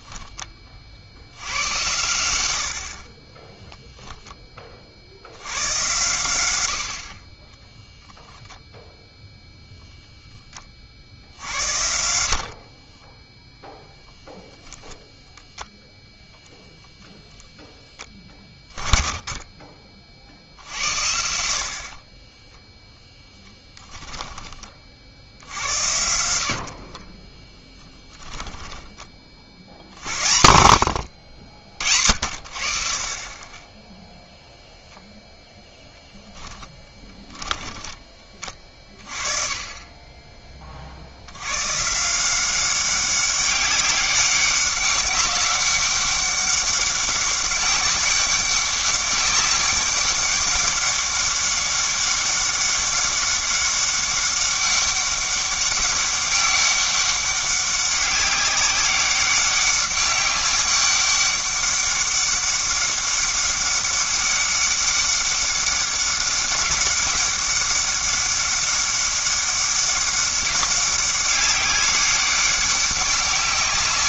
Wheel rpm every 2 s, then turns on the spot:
30, 80, 20, 100, 10, 10, 50, 0, 0, 30, 50, 10, 20, 70, 10, 80, 60, 0, 10, 20, 30, 180, 200, 200, 190, 200, 200, 200, 200, 190, 200, 200, 200, 200, 200, 200, 200.
12-14 22-24 26-30 36-38